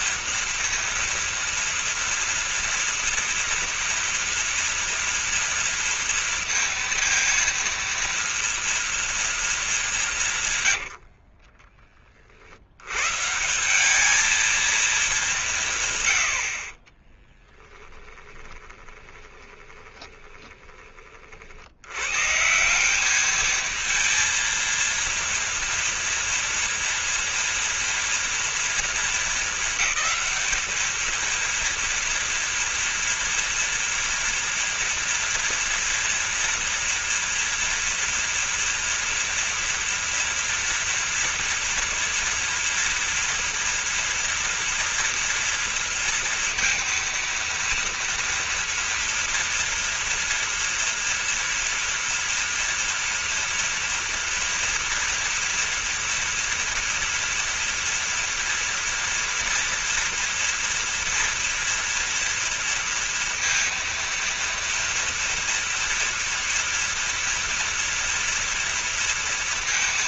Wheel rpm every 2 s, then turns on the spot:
230, 230, 240, 230, 240, 140, 80, 230, 60, 20, 20, 160, 230, 230, 230, 220, 230, 230, 230, 230, 230, 230, 230, 230, 230, 230, 230, 230, 230, 230, 230, 230, 230, 230, 230.
10-12 18-22